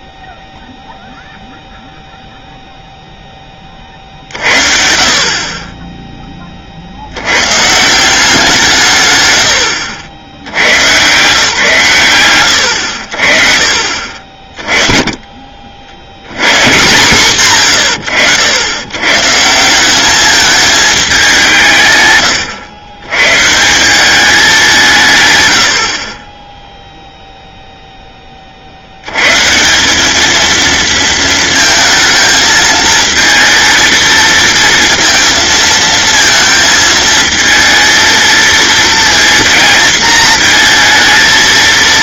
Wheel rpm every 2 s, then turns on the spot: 0, 10, 40, 90, 120, 140, 40, 50, 130, 140, 190, 140, 120, 0, 110, 230, 220, 230, 220, 230, 230.
none